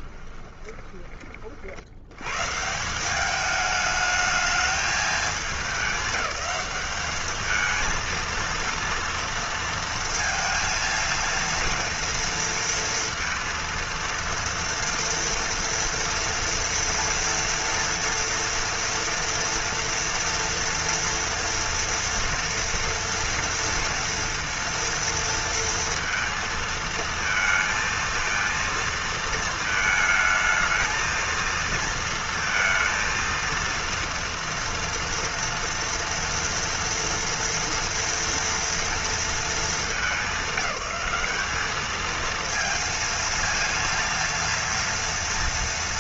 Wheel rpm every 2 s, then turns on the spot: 20, 150, 220, 210, 230, 230, 230, 230, 230, 230, 230, 230, 230, 230, 230, 220, 230, 230, 240, 230, 210, 230, 230.
0-2